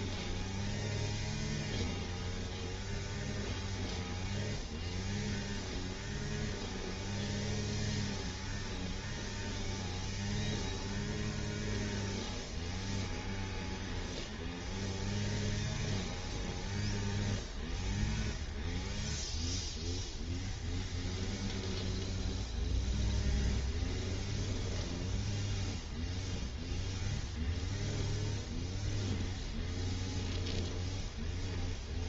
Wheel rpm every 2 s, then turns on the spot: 0, 0, 0, 0, 0, 0, 0, 0, 0, 0, 0, 0, 0, 0, 0, 0.
none